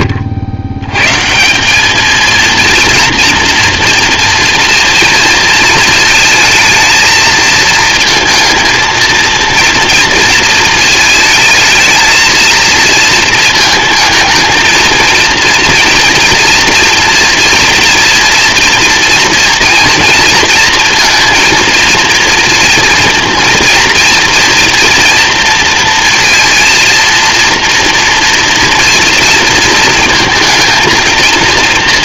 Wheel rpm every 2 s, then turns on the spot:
80, 230, 230, 220, 230, 220, 220, 220, 230, 230, 230, 230, 230, 230, 230, 230.
none